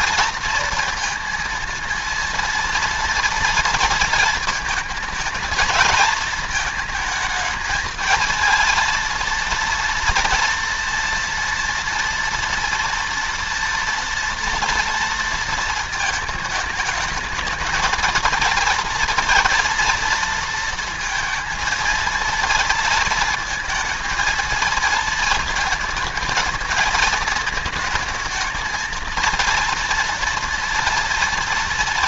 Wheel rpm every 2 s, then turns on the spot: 230, 230, 220, 220, 230, 230, 230, 230, 220, 230, 230, 220, 220, 220, 230, 230.
none